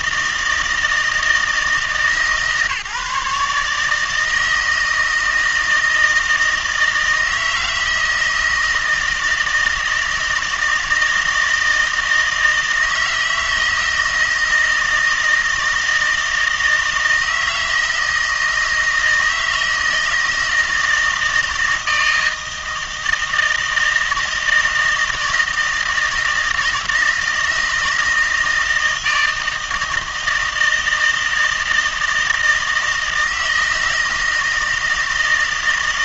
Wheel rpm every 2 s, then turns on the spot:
160, 150, 160, 160, 160, 160, 160, 160, 160, 160, 160, 160, 160, 160, 160, 160, 160, 160.
none